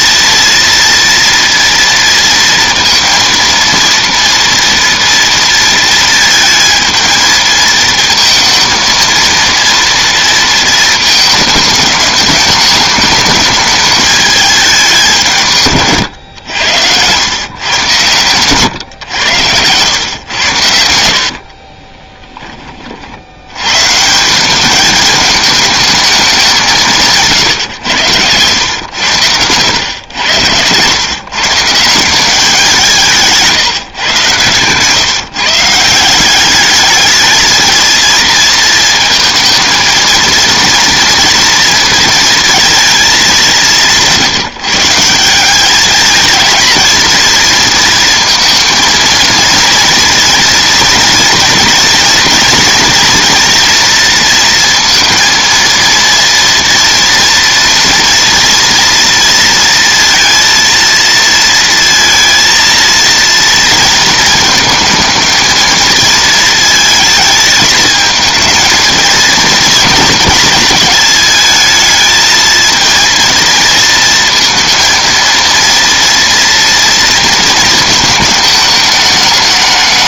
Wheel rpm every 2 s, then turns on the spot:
230, 230, 230, 220, 230, 230, 210, 210, 100, 130, 90, 20, 190, 180, 110, 110, 180, 130, 200, 230, 230, 230, 170, 230, 230, 230, 230, 230, 230, 230, 230, 230, 220, 230, 220, 220, 230, 230, 230, 220.
none